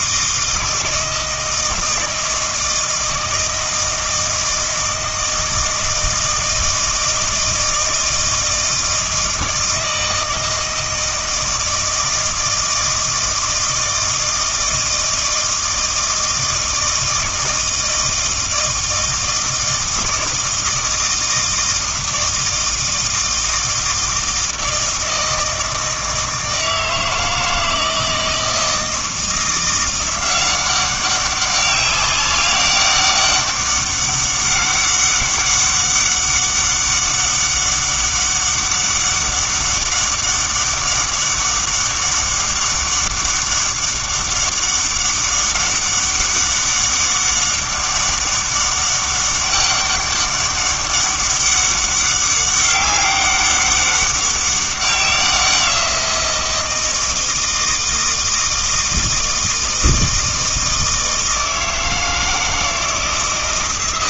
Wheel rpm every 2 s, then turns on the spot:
160, 160, 160, 160, 160, 160, 160, 160, 160, 160, 160, 160, 160, 160, 160, 190, 190, 200, 200, 200, 200, 200, 200, 200, 200, 200, 200, 190, 170, 160, 160, 160.
none